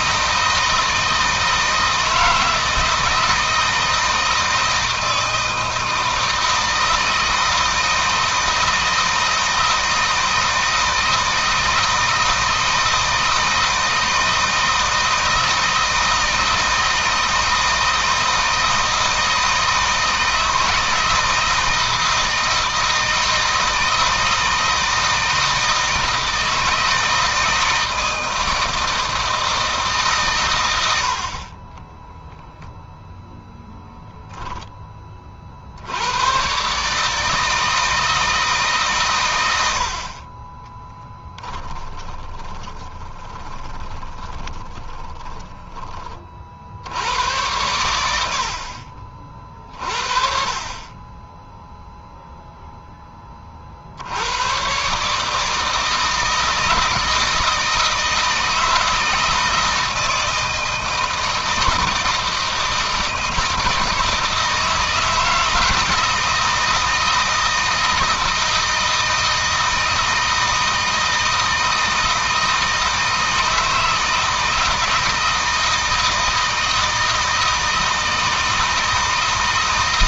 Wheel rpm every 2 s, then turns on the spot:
160, 160, 160, 160, 160, 160, 160, 160, 160, 160, 160, 160, 160, 160, 160, 100, 10, 10, 130, 150, 20, 20, 20, 60, 60, 30, 0, 110, 160, 160, 160, 160, 160, 160, 160, 160, 160, 160, 160, 160.
40-46